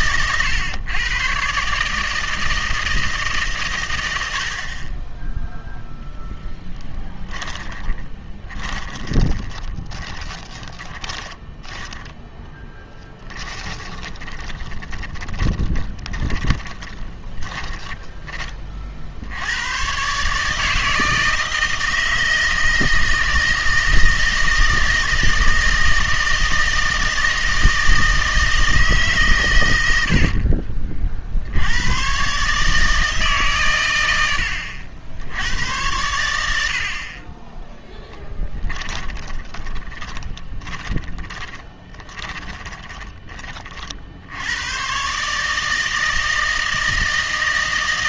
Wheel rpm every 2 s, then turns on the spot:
120, 160, 60, 20, 20, 20, 10, 20, 20, 30, 150, 160, 160, 160, 160, 40, 150, 80, 80, 20, 30, 20, 100, 160.
6-12 14-18 30-32 38-44